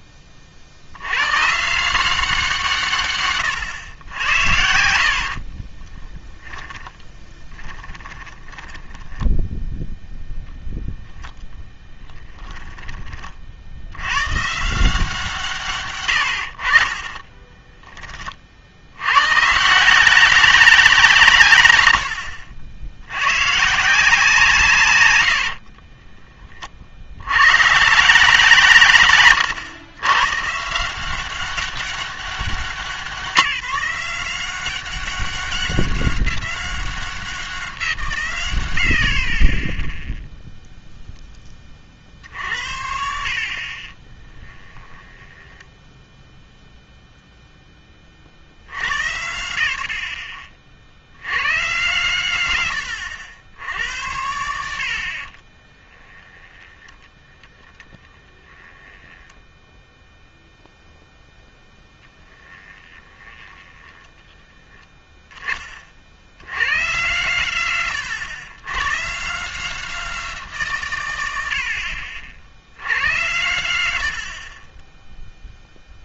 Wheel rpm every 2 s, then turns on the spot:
60, 160, 80, 10, 20, 0, 10, 140, 70, 50, 190, 70, 150, 30, 150, 150, 180, 190, 200, 120, 0, 80, 10, 0, 80, 50, 110, 90, 10, 10, 0, 10, 10, 120, 120, 170, 70, 20.
6-10 44-46 56-60 62-64